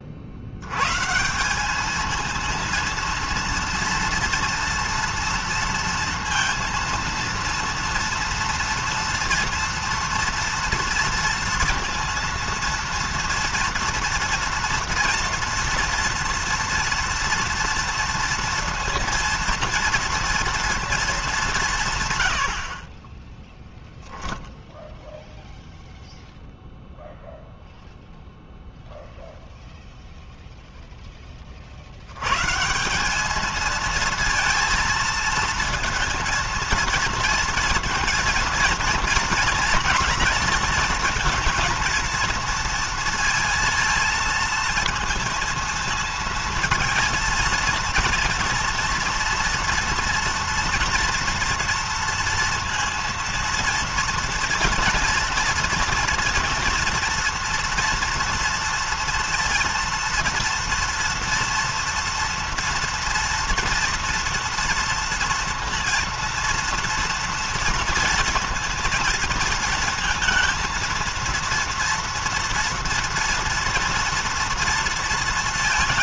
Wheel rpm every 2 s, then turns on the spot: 90, 230, 230, 230, 230, 230, 230, 230, 230, 230, 230, 90, 0, 0, 0, 0, 140, 230, 230, 230, 230, 230, 220, 230, 230, 230, 230, 230, 230, 230, 230, 230, 230, 230, 230, 230, 230, 230.
22-24